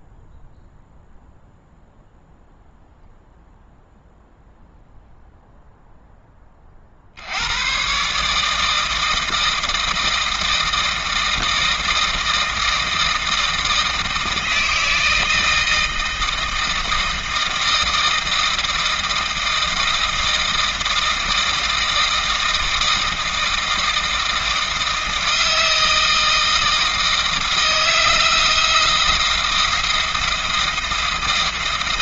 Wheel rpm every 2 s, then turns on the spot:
0, 0, 0, 50, 160, 160, 160, 160, 160, 160, 160, 160, 160, 160, 160, 170.
none